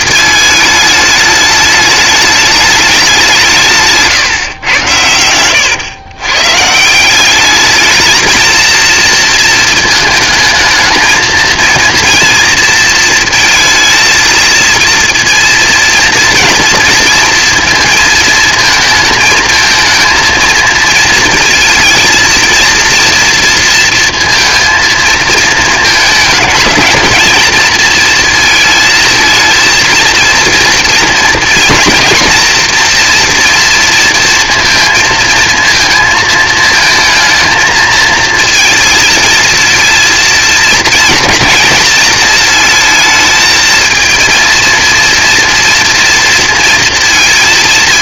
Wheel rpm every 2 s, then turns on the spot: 210, 210, 120, 140, 230, 220, 230, 230, 230, 220, 230, 230, 230, 220, 230, 230, 230, 230, 220, 230, 230, 230, 230, 230.
none